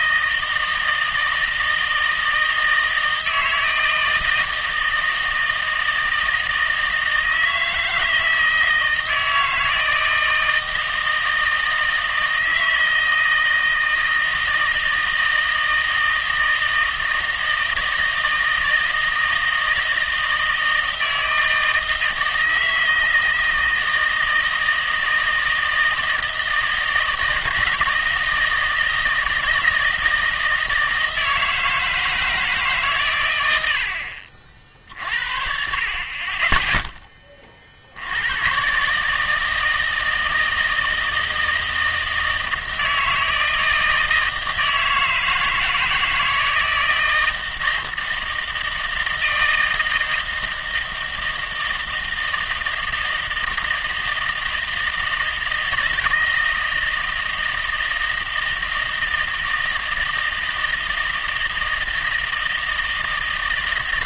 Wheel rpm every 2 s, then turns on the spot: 160, 160, 160, 160, 160, 160, 160, 160, 160, 160, 160, 160, 160, 160, 160, 160, 150, 50, 10, 130, 160, 160, 160, 160, 160, 160, 160, 160, 160, 160, 160, 160.
none